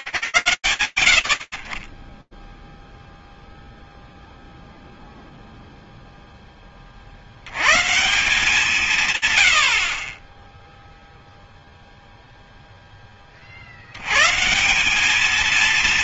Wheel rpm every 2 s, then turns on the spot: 50, 0, 0, 60, 200, 0, 80, 210.
none